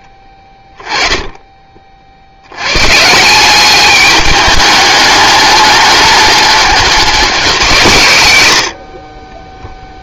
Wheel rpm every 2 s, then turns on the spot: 10, 100, 210, 210, 110.
none